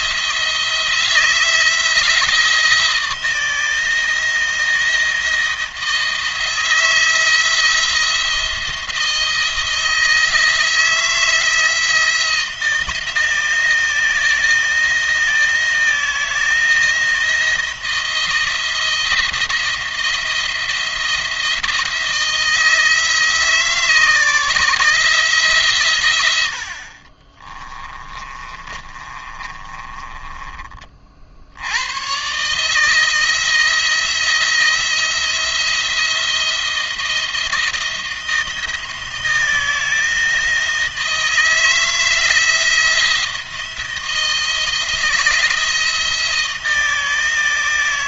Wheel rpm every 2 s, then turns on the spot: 160, 170, 160, 170, 170, 160, 170, 170, 170, 170, 170, 160, 160, 70, 30, 50, 140, 170, 170, 170, 160, 170, 170, 160.
28-30